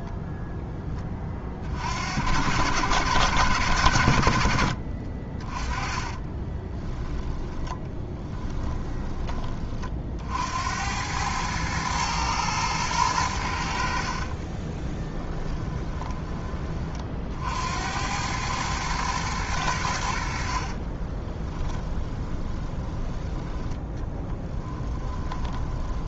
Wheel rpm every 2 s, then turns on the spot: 10, 100, 60, 10, 10, 80, 110, 20, 30, 110, 40, 10, 10.
6-8 14-16 20-26